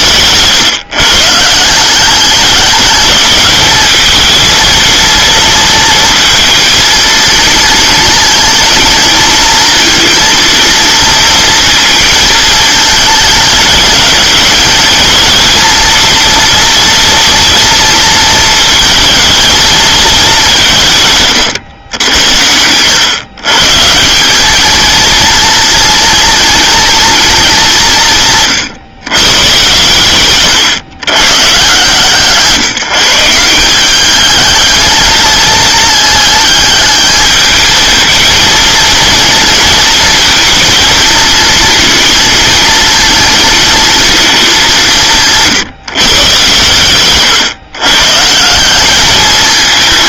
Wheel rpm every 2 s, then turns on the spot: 150, 200, 230, 230, 220, 230, 210, 220, 230, 220, 160, 110, 220, 230, 140, 130, 160, 220, 220, 230, 220, 220, 190, 130, 190.
none